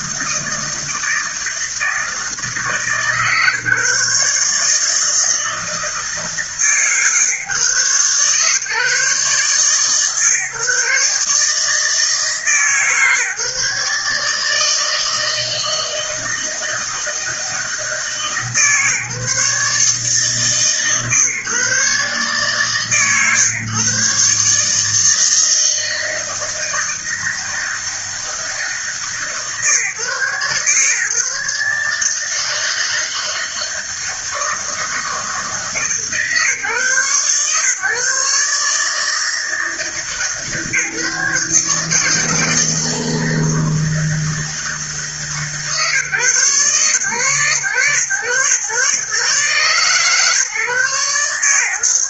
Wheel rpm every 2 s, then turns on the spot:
160, 150, 160, 150, 140, 140, 150, 160, 160, 150, 140, 130, 160, 160, 150, 140, 160, 160, 130, 150, 150, 160, 160, 130, 120, 130.
none